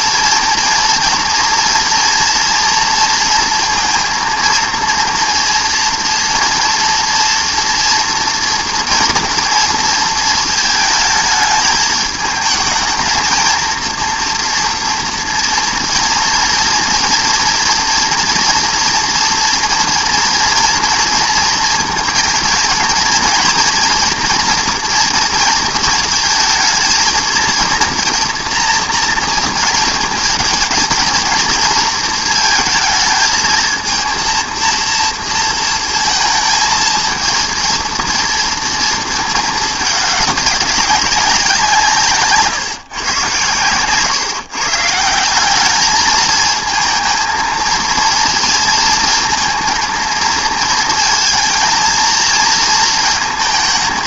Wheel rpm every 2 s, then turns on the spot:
230, 230, 230, 230, 230, 220, 220, 230, 230, 230, 230, 230, 230, 220, 240, 230, 220, 230, 230, 220, 190, 140, 140, 220, 230, 220, 220.
none